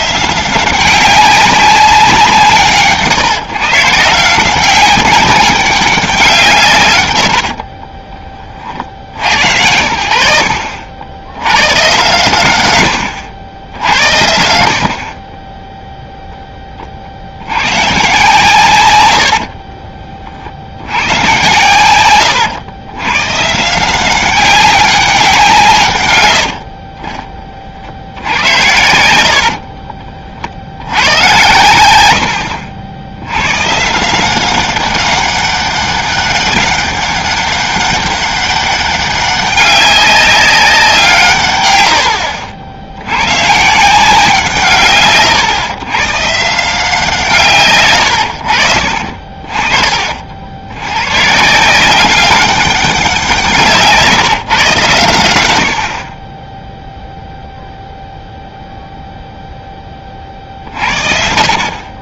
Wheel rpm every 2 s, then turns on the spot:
180, 150, 190, 130, 50, 70, 110, 70, 30, 110, 70, 100, 190, 50, 90, 100, 60, 190, 200, 200, 180, 70, 140, 160, 60, 100, 190, 130, 10, 0, 60.
26-30 48-50